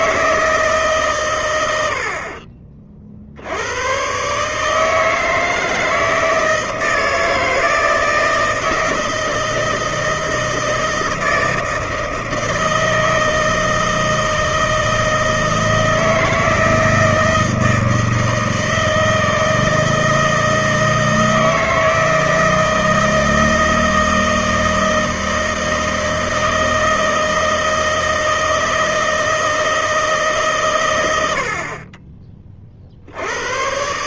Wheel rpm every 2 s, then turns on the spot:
150, 30, 150, 160, 160, 160, 160, 160, 160, 160, 160, 160, 160, 160, 160, 140, 20.
none